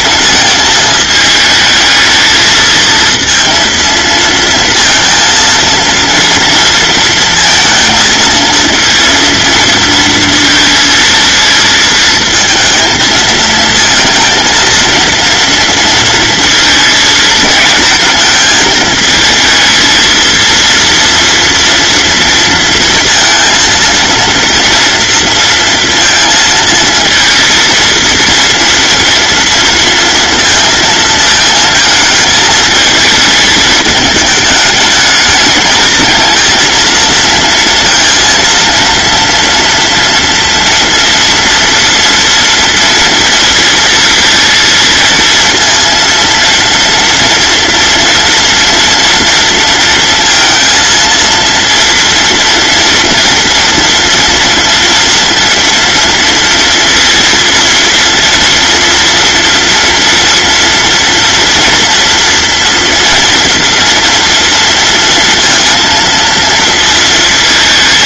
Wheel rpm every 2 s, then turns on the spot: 220, 230, 230, 230, 230, 230, 220, 230, 230, 220, 230, 230, 240, 230, 230, 230, 220, 220, 230, 230, 230, 230, 230, 230, 230, 230, 230, 230, 230, 230, 230, 230, 230, 230.
none